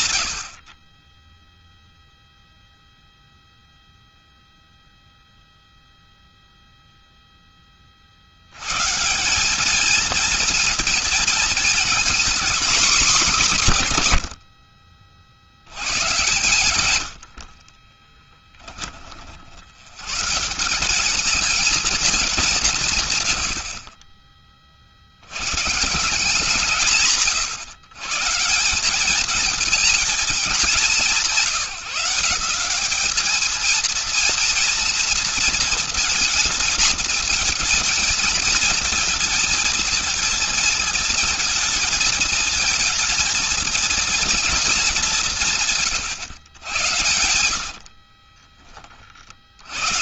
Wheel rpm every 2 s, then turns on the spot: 10, 0, 0, 20, 200, 230, 150, 90, 40, 80, 220, 70, 160, 150, 230, 180, 230, 230, 220, 230, 230, 230, 150, 70, 80.
16-18 46-48